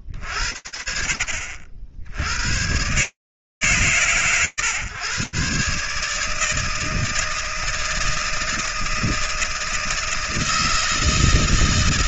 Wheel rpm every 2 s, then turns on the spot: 30, 70, 130, 150, 160, 160.
none